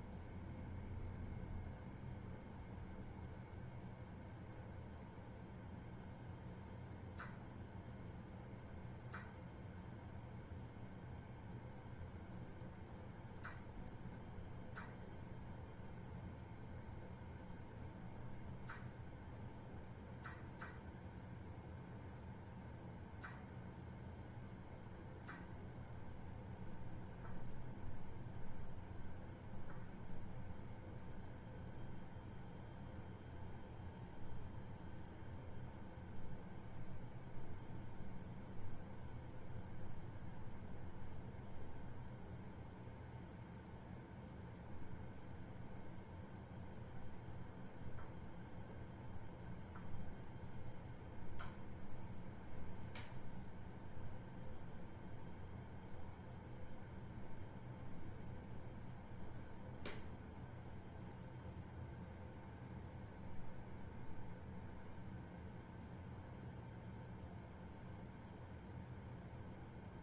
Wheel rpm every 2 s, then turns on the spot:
0, 0, 0, 0, 0, 0, 0, 0, 0, 0, 0, 0, 0, 0, 0, 0, 0, 0, 0, 0, 0, 0, 0, 0, 0, 0, 0, 0, 0, 0, 0, 0, 0, 0, 0.
none